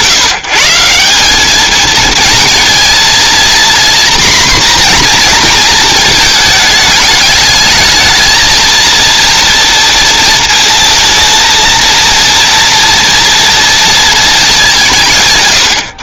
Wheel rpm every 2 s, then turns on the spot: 170, 230, 240, 210, 230, 230, 230, 190.
none